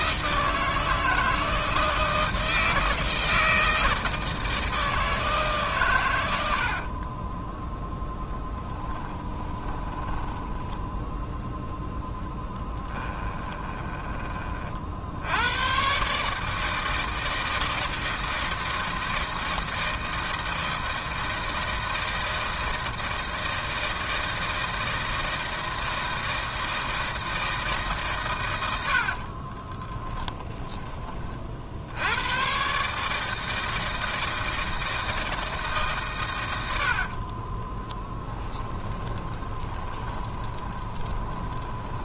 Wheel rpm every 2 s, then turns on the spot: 160, 160, 160, 50, 10, 10, 10, 50, 160, 160, 160, 160, 160, 160, 90, 10, 130, 160, 80, 20, 20.
6-10 12-14 36-42